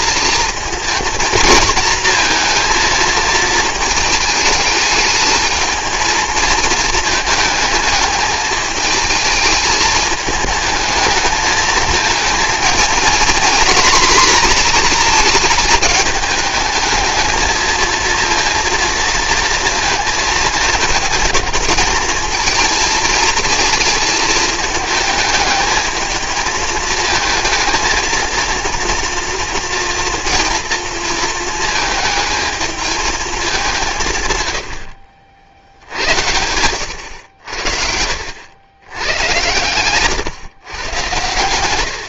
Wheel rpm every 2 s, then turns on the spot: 220, 230, 210, 220, 220, 210, 230, 230, 210, 230, 220, 220, 220, 220, 230, 230, 220, 90, 100, 90, 120.
none